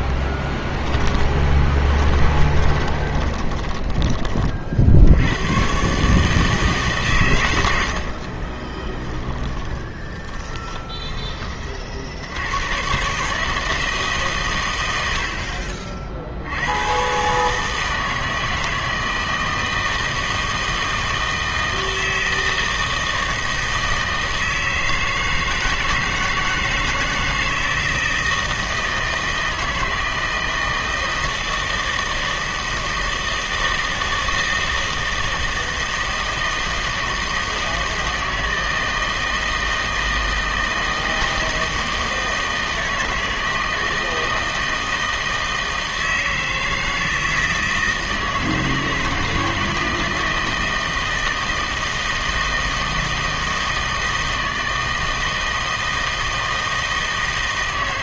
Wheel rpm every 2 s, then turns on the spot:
10, 20, 50, 150, 30, 10, 100, 120, 80, 160, 160, 160, 160, 160, 160, 160, 160, 160, 160, 160, 160, 160, 160, 160, 160, 160, 160, 160, 160.
0-4 8-12